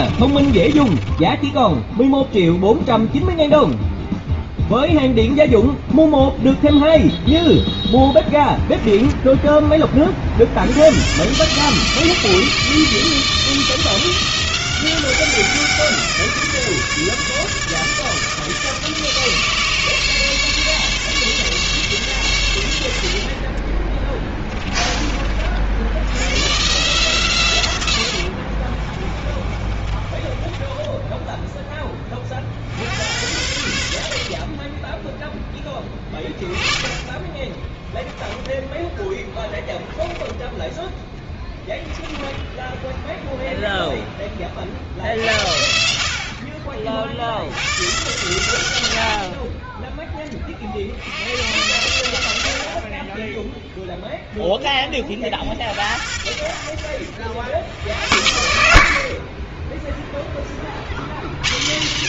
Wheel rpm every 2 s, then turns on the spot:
30, 0, 0, 0, 10, 70, 160, 180, 160, 160, 150, 100, 10, 130, 50, 20, 60, 30, 20, 10, 0, 10, 30, 50, 120, 40, 70, 10, 70, 70, 40.
0-2 8-10 28-32 42-44